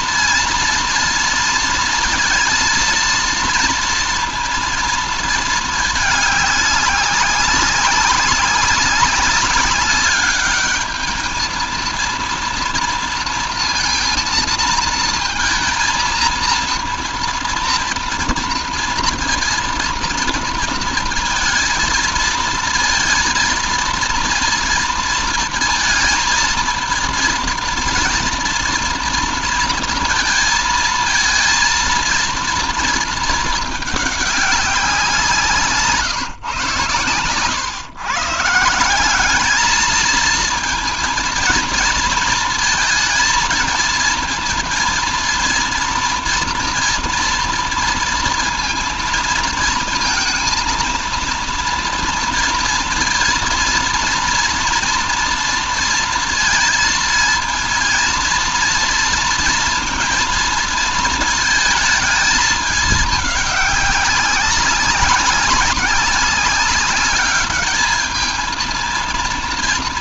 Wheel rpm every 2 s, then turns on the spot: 230, 230, 230, 190, 200, 220, 230, 230, 230, 230, 230, 230, 220, 230, 230, 220, 230, 180, 130, 190, 230, 220, 230, 230, 230, 230, 230, 230, 230, 230, 220, 210, 200, 210, 230.
none